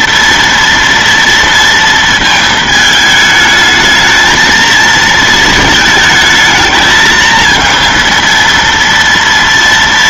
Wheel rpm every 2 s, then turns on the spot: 230, 220, 220, 220, 230.
none